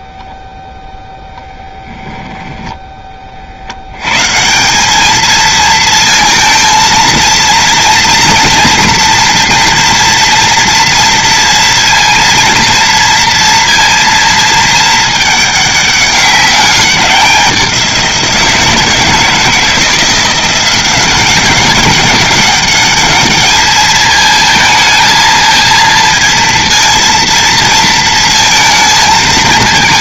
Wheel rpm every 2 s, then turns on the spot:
0, 10, 180, 230, 240, 230, 230, 220, 200, 160, 180, 210, 220, 230, 230.
none